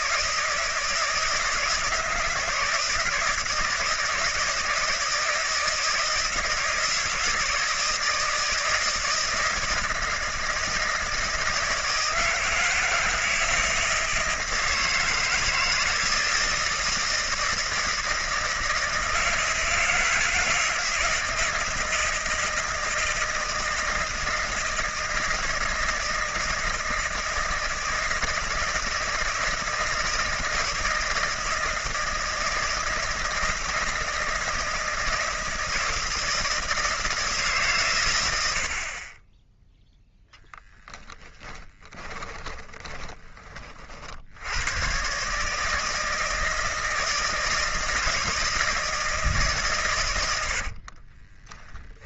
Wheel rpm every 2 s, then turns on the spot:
160, 160, 160, 160, 160, 160, 160, 160, 160, 160, 160, 160, 160, 160, 160, 160, 160, 160, 160, 40, 10, 20, 110, 160, 160, 50.
40-44 50-52